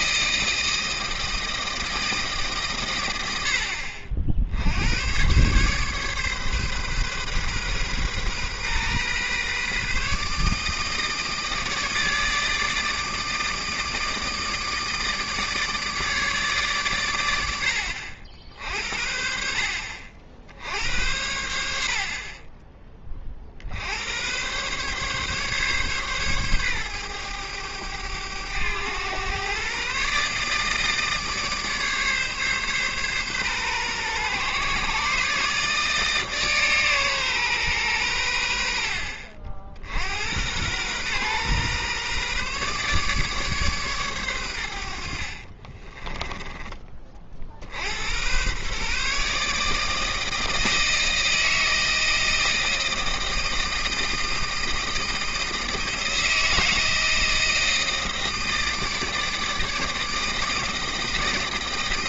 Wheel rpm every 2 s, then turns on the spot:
160, 140, 70, 140, 130, 150, 160, 160, 140, 60, 70, 30, 120, 120, 100, 150, 140, 130, 140, 70, 100, 140, 100, 20, 120, 160, 160, 160, 160, 160, 160.
none